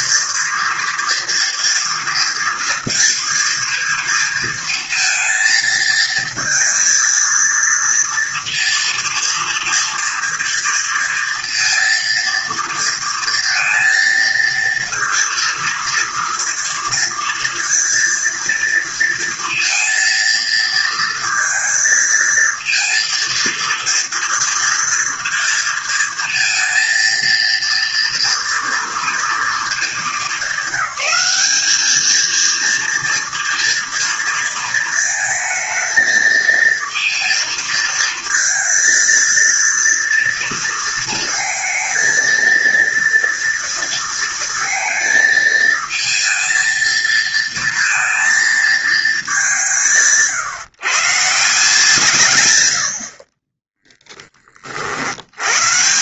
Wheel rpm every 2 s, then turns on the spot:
240, 230, 230, 230, 230, 230, 230, 230, 230, 230, 230, 230, 230, 230, 230, 200, 230, 220, 230, 230, 230, 230, 220, 230, 210, 160, 40, 80.
none